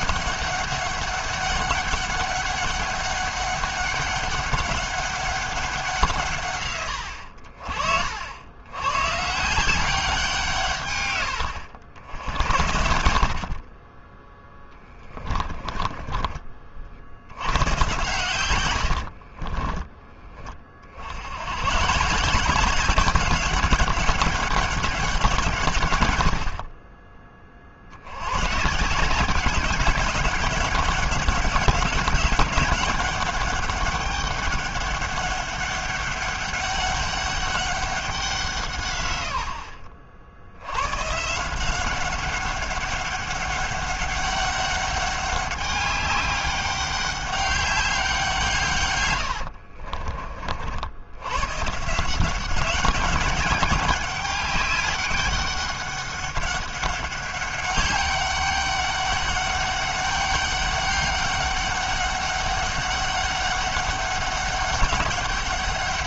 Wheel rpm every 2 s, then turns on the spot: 200, 200, 200, 120, 100, 150, 80, 10, 50, 100, 40, 180, 190, 50, 140, 200, 200, 200, 200, 150, 100, 200, 200, 200, 140, 50, 190, 200, 200, 200, 200, 200, 190.
14-16 18-20